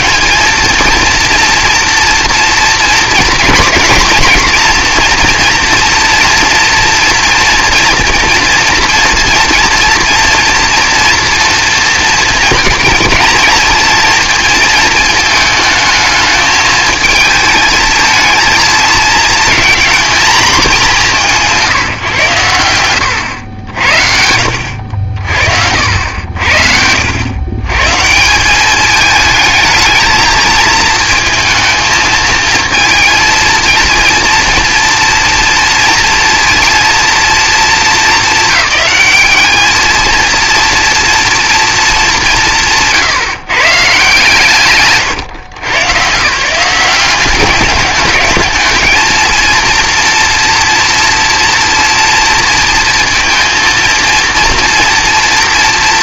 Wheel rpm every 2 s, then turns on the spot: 230, 230, 240, 240, 230, 240, 230, 220, 220, 220, 190, 100, 70, 70, 200, 220, 230, 230, 230, 220, 230, 180, 160, 180, 210, 230, 230, 230.
none